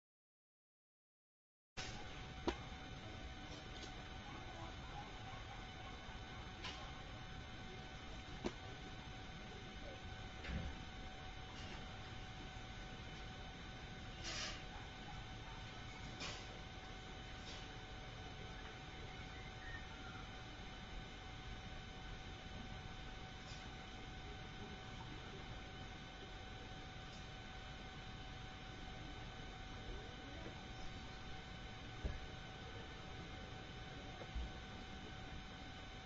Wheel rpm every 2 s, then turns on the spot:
0, 0, 0, 0, 0, 0, 0, 0, 0, 0, 0, 0, 0, 0, 0, 0, 0, 0.
none